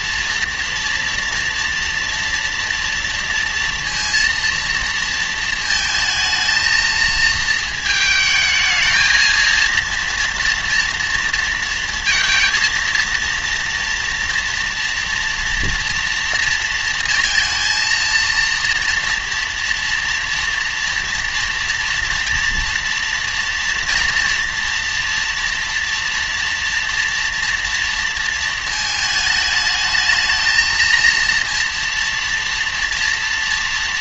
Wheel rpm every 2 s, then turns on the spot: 230, 230, 230, 220, 220, 230, 230, 240, 230, 230, 230, 230, 230, 230, 220, 230, 230.
none